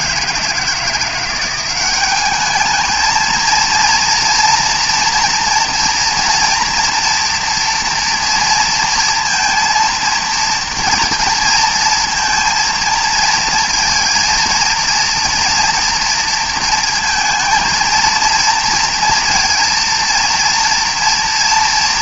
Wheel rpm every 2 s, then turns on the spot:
170, 220, 240, 230, 230, 230, 230, 230, 230, 230, 230.
none